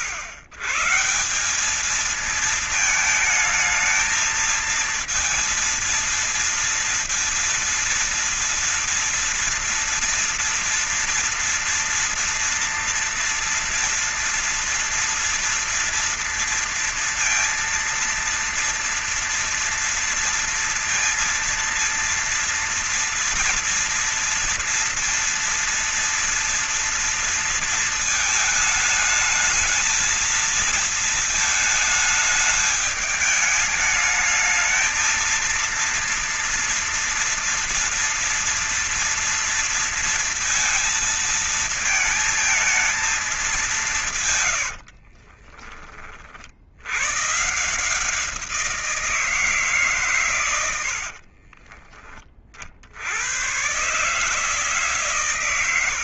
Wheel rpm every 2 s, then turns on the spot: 130, 220, 220, 230, 230, 230, 230, 240, 230, 230, 230, 230, 230, 230, 220, 220, 210, 220, 230, 240, 230, 220, 120, 60, 170, 110, 30, 140.
44-46 50-52